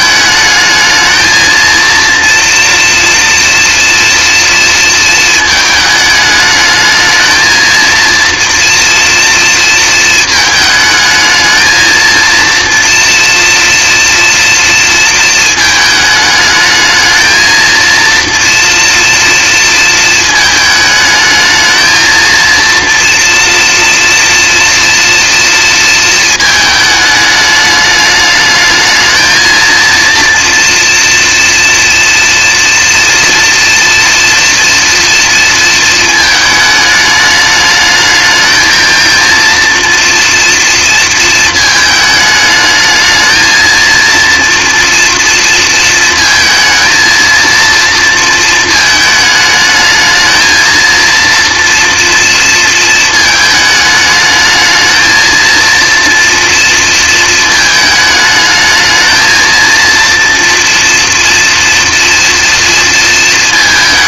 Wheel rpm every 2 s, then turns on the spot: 220, 230, 230, 220, 230, 220, 230, 230, 220, 230, 220, 230, 230, 220, 210, 230, 230, 230, 210, 220, 230, 220, 230, 230, 220, 230, 230, 230, 230, 220, 230, 230.
none